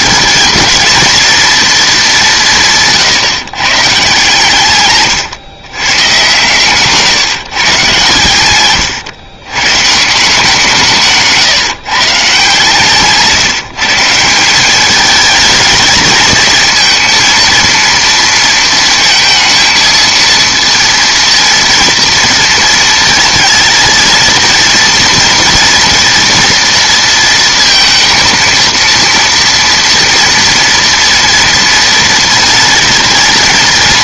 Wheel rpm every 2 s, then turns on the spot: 220, 170, 150, 130, 110, 170, 150, 190, 220, 230, 230, 230, 230, 230, 230, 230, 230.
none